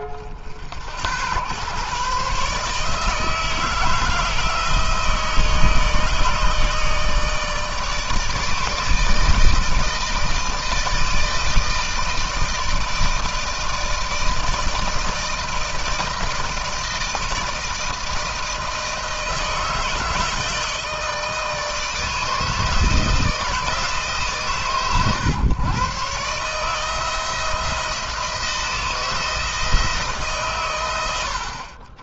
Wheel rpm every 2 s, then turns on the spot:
60, 150, 160, 160, 160, 160, 160, 160, 160, 160, 160, 160, 120, 160, 160, 120.
none